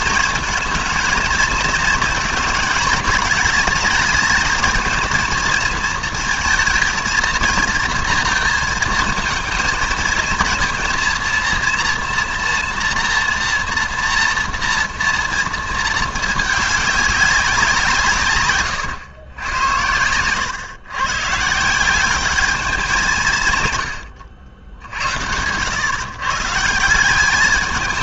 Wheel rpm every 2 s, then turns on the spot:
230, 220, 220, 230, 220, 220, 240, 230, 200, 120, 110, 200, 80, 170.
none